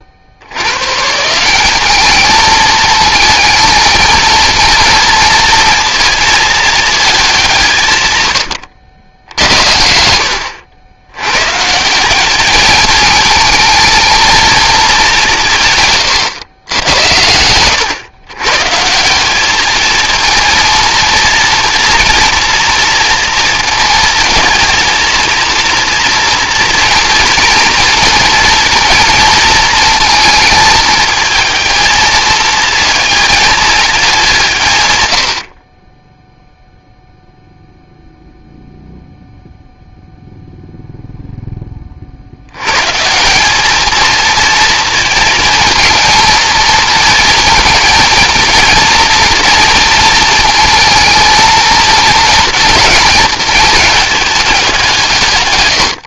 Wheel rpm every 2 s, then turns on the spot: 170, 220, 230, 200, 80, 100, 220, 190, 100, 170, 230, 230, 230, 230, 230, 220, 230, 110, 0, 0, 0, 110, 230, 220, 230, 220, 230, 190.
none